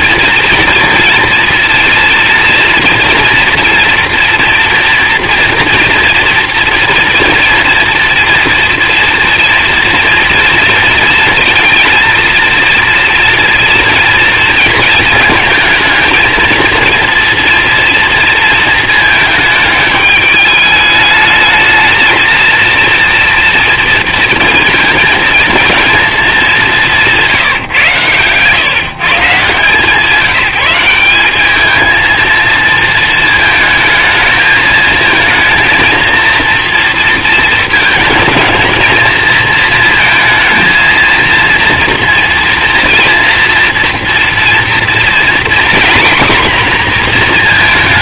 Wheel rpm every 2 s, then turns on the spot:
230, 230, 240, 230, 230, 230, 230, 230, 230, 220, 210, 230, 230, 180, 150, 190, 220, 220, 230, 230, 230, 230, 240, 240.
none